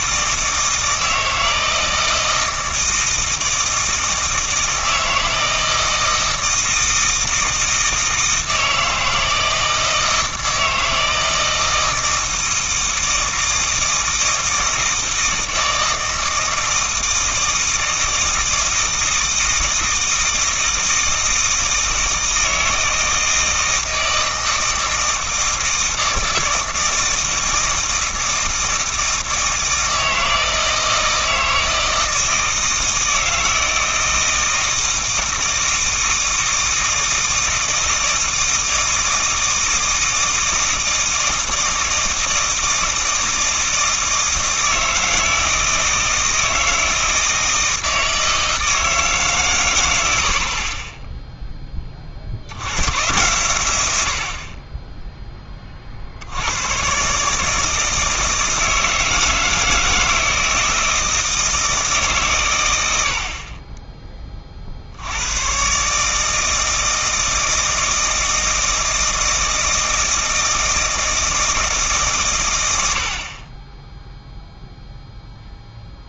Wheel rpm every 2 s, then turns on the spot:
160, 160, 160, 160, 160, 160, 160, 160, 160, 160, 160, 160, 160, 160, 160, 160, 160, 160, 160, 160, 160, 160, 160, 160, 160, 30, 90, 30, 110, 160, 160, 100, 50, 160, 160, 160, 100, 0.
none